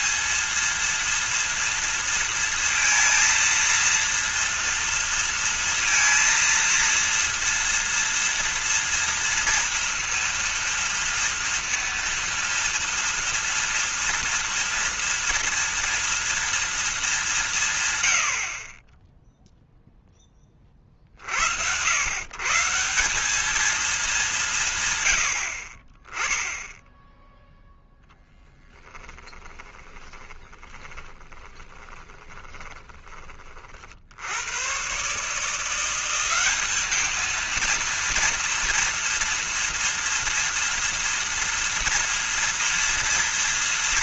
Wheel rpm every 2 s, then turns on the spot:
220, 230, 230, 230, 230, 230, 230, 230, 230, 50, 30, 150, 180, 10, 10, 30, 20, 80, 200, 230, 230, 230.
28-34